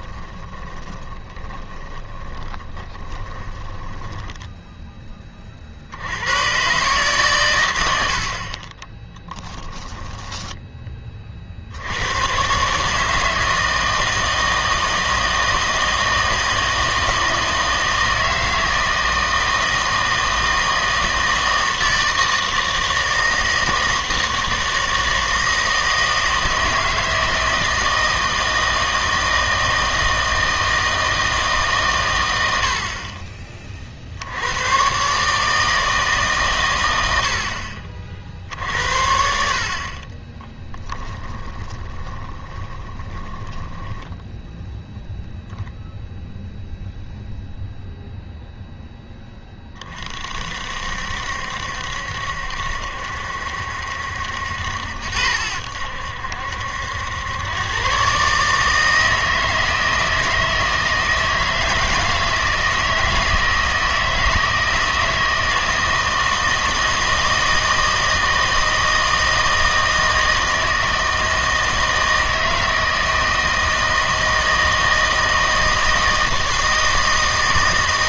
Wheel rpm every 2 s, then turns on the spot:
20, 20, 10, 130, 50, 10, 130, 160, 160, 160, 160, 160, 160, 160, 160, 160, 80, 90, 130, 60, 10, 20, 0, 0, 0, 50, 70, 80, 80, 150, 160, 160, 160, 160, 160, 160, 160, 160, 160.
0-6 8-10 40-44